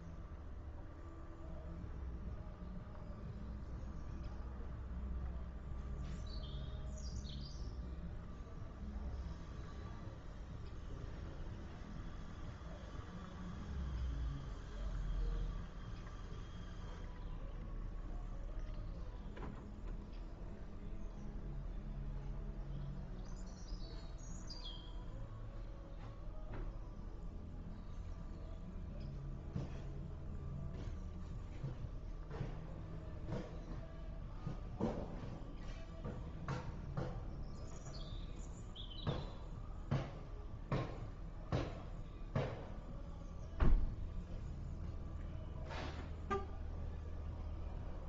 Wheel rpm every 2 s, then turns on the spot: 0, 0, 0, 0, 0, 0, 0, 0, 0, 0, 0, 0, 0, 0, 0, 0, 0, 0, 0, 0, 0, 0, 0, 0.
none